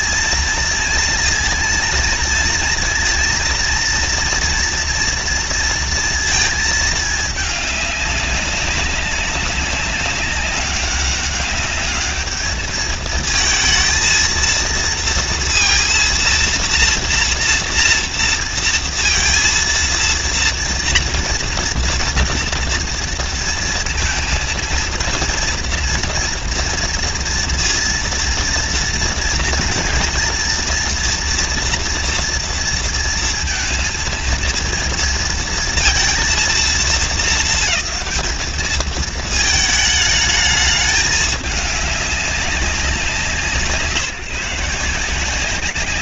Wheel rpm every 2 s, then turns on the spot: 230, 230, 230, 230, 200, 200, 210, 230, 230, 230, 230, 230, 230, 230, 230, 230, 230, 230, 220, 210, 210, 190, 180.
none